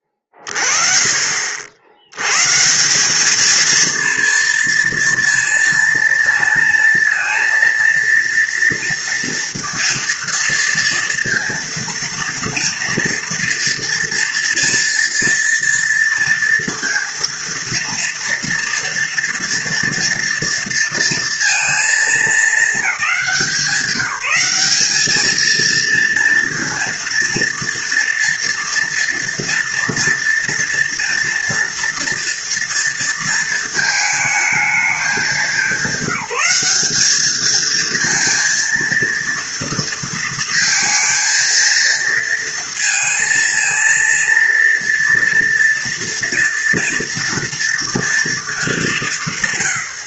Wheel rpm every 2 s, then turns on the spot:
30, 140, 230, 230, 230, 230, 230, 230, 230, 230, 230, 210, 200, 230, 230, 230, 230, 220, 190, 230, 230, 230, 230, 230, 210.
none